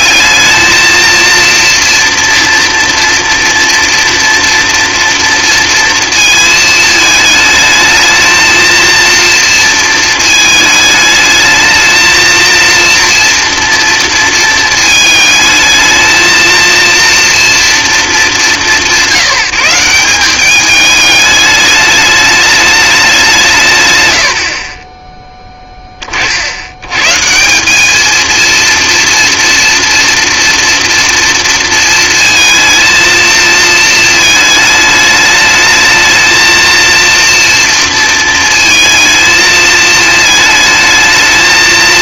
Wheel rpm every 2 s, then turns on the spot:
220, 230, 230, 220, 230, 220, 230, 220, 230, 190, 210, 210, 30, 100, 230, 240, 230, 210, 230, 230, 220.
none